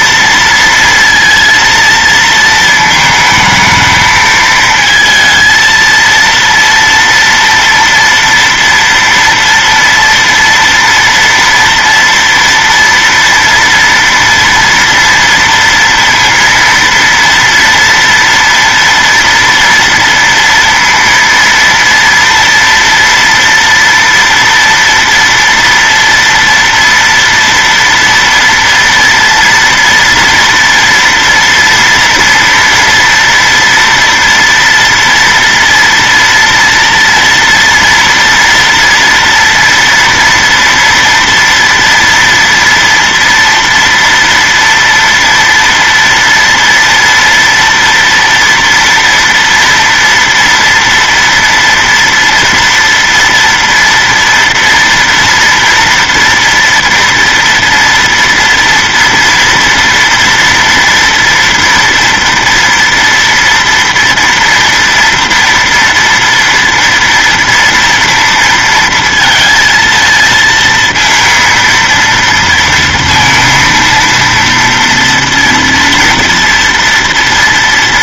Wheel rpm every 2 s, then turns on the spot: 230, 220, 220, 230, 230, 230, 230, 230, 230, 240, 230, 230, 230, 240, 230, 230, 230, 230, 240, 230, 230, 230, 230, 230, 230, 230, 230, 230, 240, 230, 230, 230, 230, 230, 230, 230, 230, 230, 230.
none